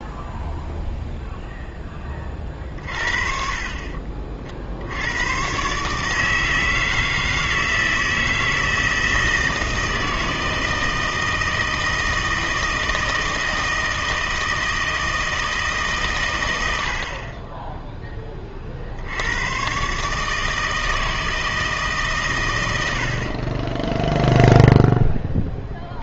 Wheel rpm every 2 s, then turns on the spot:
0, 40, 60, 160, 160, 160, 160, 160, 100, 30, 160, 100, 0.
none